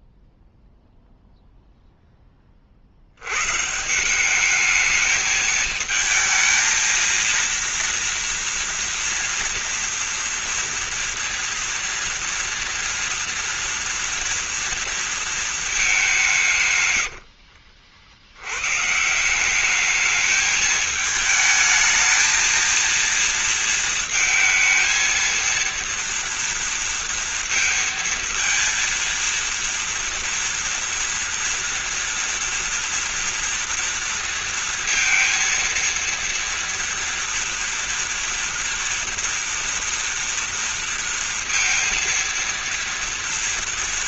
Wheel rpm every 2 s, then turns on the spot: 0, 40, 210, 230, 230, 230, 230, 230, 110, 130, 220, 230, 220, 230, 230, 230, 230, 230, 240, 240, 230, 230.
none